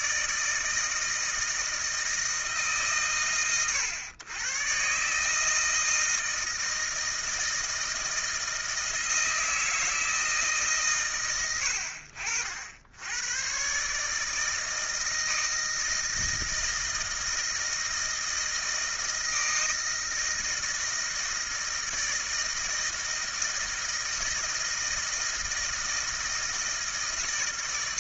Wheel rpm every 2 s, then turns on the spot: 160, 120, 120, 160, 160, 140, 70, 160, 160, 160, 160, 160, 160, 160.
none